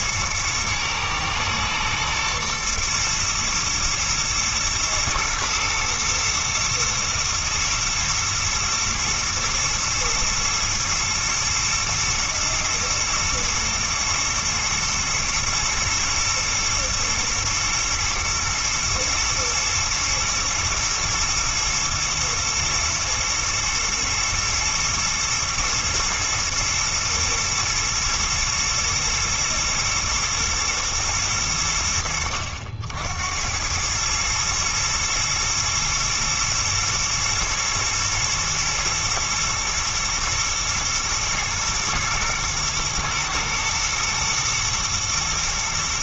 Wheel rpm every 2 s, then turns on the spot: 120, 120, 120, 120, 110, 110, 110, 110, 110, 110, 110, 120, 120, 110, 110, 110, 70, 110, 120, 110, 110, 110, 120.
none